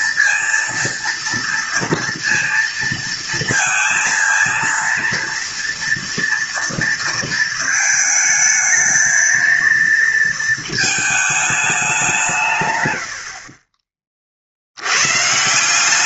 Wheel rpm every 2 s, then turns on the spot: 230, 230, 230, 230, 220, 220, 140, 70.
none